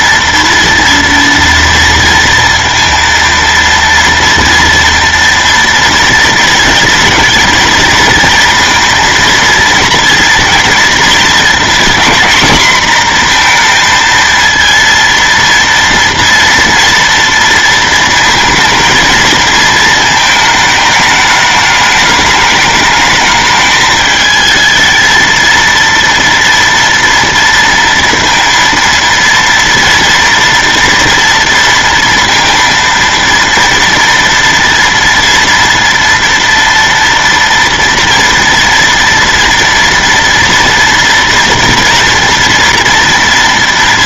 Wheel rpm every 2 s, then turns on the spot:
230, 230, 240, 240, 230, 230, 240, 230, 230, 230, 210, 210, 220, 230, 230, 230, 230, 240, 230, 230, 230, 230.
none